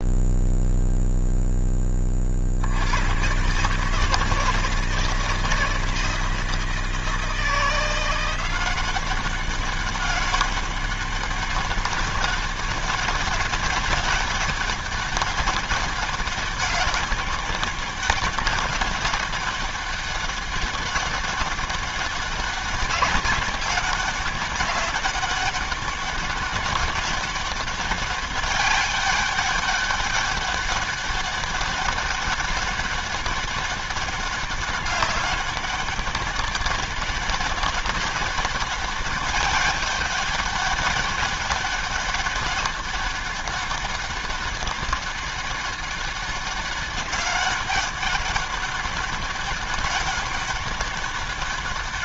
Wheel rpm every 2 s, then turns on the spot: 0, 50, 160, 160, 180, 200, 200, 200, 190, 200, 200, 190, 200, 200, 200, 200, 200, 200, 190, 200, 200, 200, 200, 200, 200, 200.
none